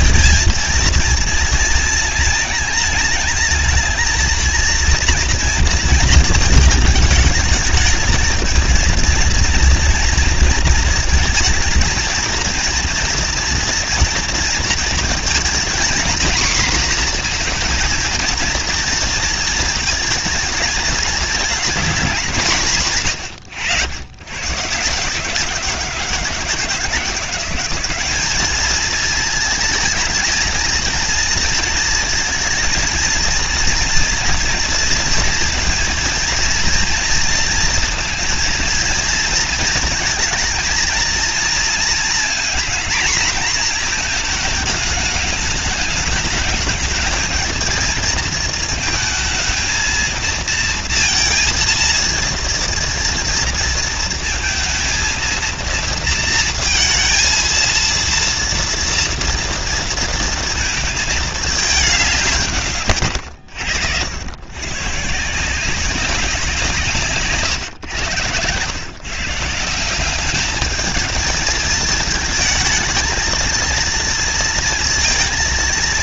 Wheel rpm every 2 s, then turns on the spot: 230, 220, 230, 220, 230, 230, 230, 220, 240, 230, 220, 150, 150, 160, 220, 230, 230, 230, 230, 220, 230, 230, 210, 220, 230, 230, 230, 230, 230, 230, 220, 110, 150, 150, 140, 220, 220, 230.
none